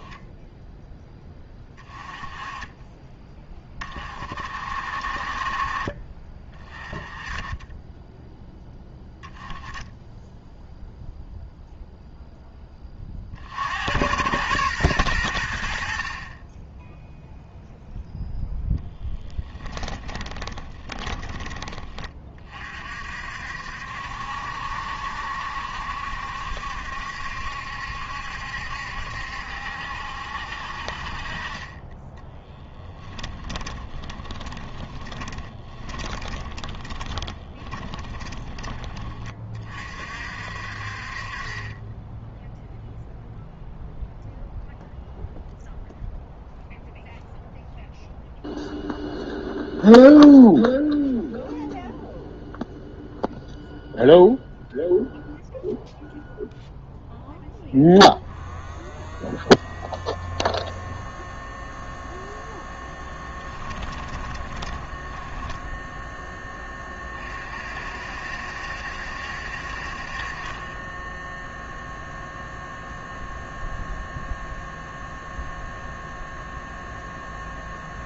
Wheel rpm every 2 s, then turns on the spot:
10, 20, 50, 20, 0, 0, 30, 100, 0, 10, 20, 50, 70, 70, 70, 50, 10, 20, 20, 20, 40, 0, 0, 0, 0, 0, 0, 0, 0, 0, 0, 10, 10, 30, 60, 10, 0, 0, 0.
18-22 32-38 62-66